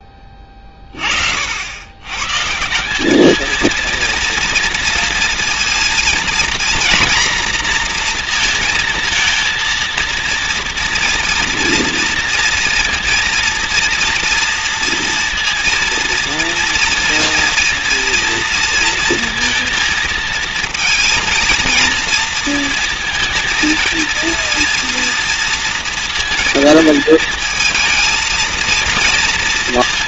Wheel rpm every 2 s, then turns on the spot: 30, 160, 230, 240, 230, 230, 230, 230, 230, 230, 230, 230, 230, 230, 230.
none